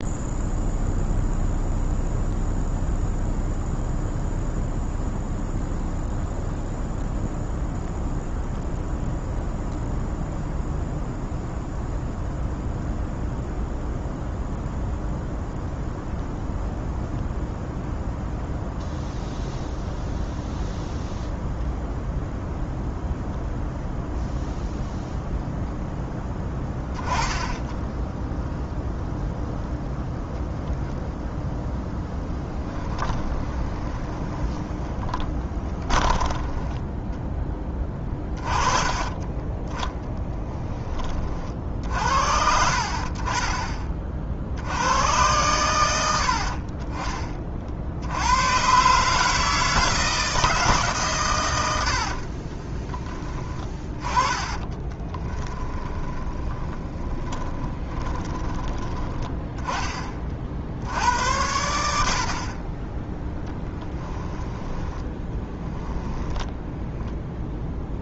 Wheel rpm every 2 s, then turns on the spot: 0, 0, 0, 0, 0, 0, 0, 0, 0, 0, 0, 0, 0, 10, 0, 0, 10, 10, 10, 20, 20, 50, 90, 40, 130, 150, 20, 10, 20, 30, 70, 20, 10, 10.
32-40 52-58 64-66